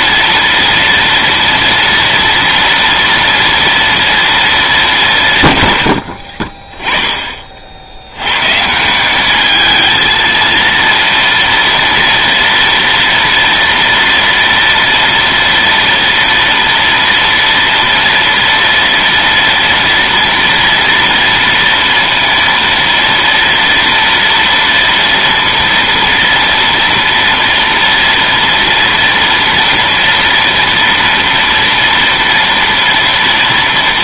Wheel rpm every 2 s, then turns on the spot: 240, 230, 210, 30, 150, 230, 230, 230, 230, 240, 230, 230, 230, 230, 230, 230, 230.
none